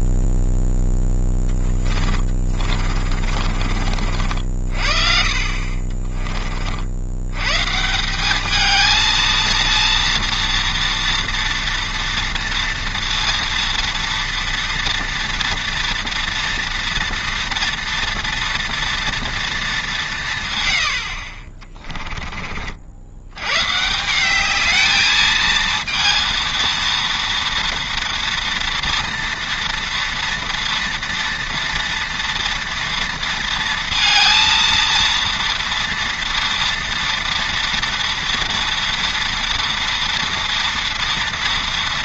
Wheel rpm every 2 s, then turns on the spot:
0, 30, 50, 60, 220, 230, 230, 230, 230, 230, 80, 50, 210, 230, 240, 230, 230, 230, 230, 230, 230.
2-4